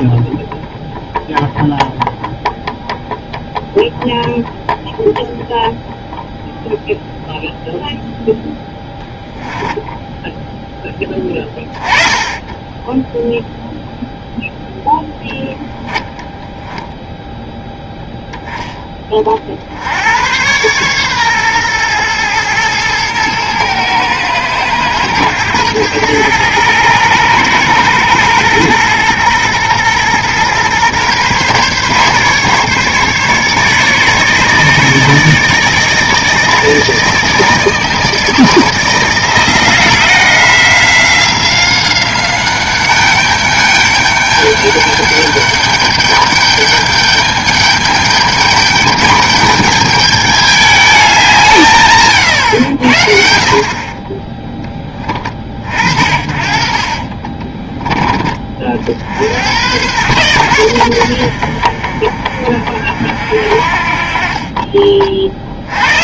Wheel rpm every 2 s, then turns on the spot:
0, 0, 0, 0, 10, 10, 10, 10, 10, 20, 120, 110, 110, 110, 120, 130, 140, 150, 160, 160, 180, 200, 200, 210, 210, 200, 70, 20, 40, 60, 80, 50, 40.
8-10 14-18 56-58